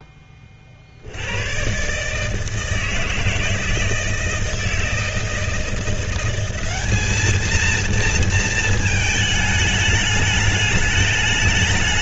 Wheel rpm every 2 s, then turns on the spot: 40, 160, 160, 190, 220, 210.
none